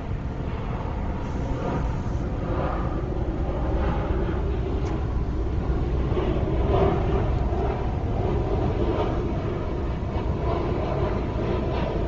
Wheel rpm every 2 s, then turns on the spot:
0, 0, 0, 0, 0, 0.
none